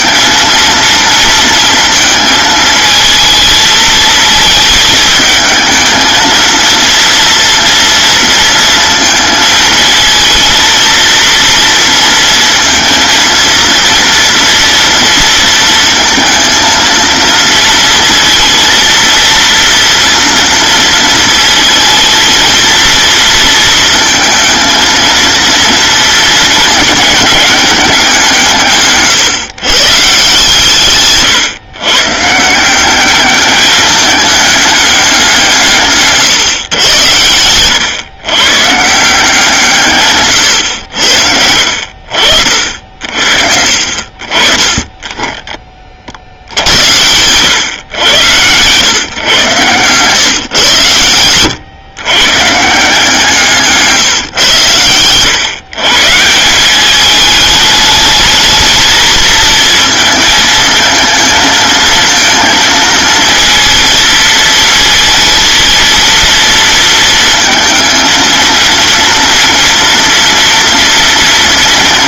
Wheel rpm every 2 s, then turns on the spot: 230, 220, 220, 230, 230, 230, 230, 230, 230, 230, 230, 230, 230, 210, 130, 130, 200, 180, 120, 170, 80, 60, 20, 110, 120, 110, 160, 120, 210, 220, 220, 230, 230, 220, 230, 230.
50-52